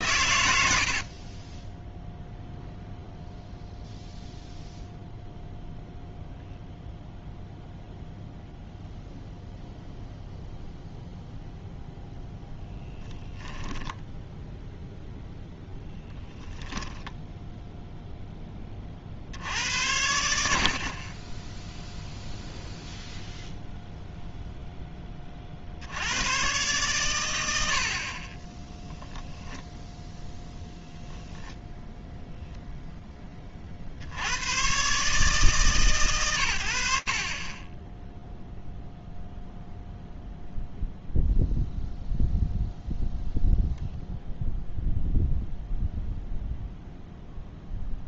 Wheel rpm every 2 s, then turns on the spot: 0, 0, 0, 0, 0, 0, 0, 0, 0, 50, 30, 0, 10, 120, 10, 0, 30, 150, 40, 0, 0, 0, 0, 0.
none